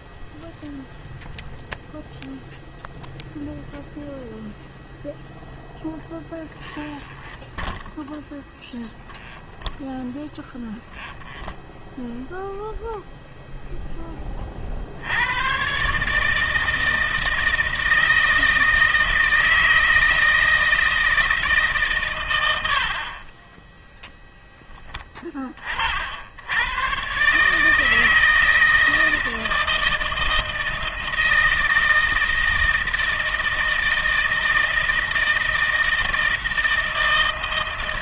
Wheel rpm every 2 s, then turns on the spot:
0, 0, 0, 10, 0, 0, 0, 60, 160, 160, 160, 60, 10, 120, 160, 160, 160, 160, 160.
6-8 22-24